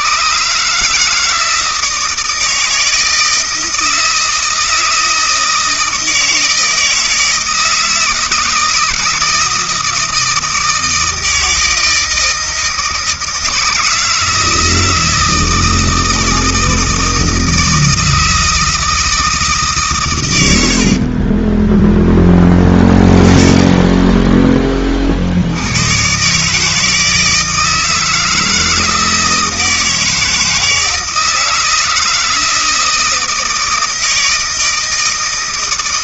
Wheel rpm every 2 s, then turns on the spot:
150, 160, 160, 160, 160, 160, 160, 160, 160, 160, 90, 10, 20, 150, 160, 160, 160, 160.
20-22